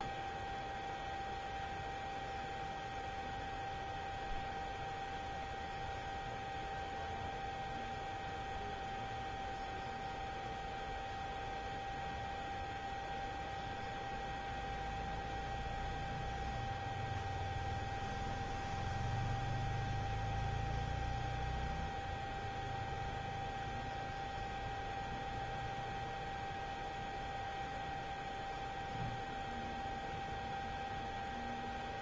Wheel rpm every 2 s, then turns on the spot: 0, 0, 0, 0, 0, 0, 0, 0, 0, 0, 0, 0, 0, 0, 0, 0.
none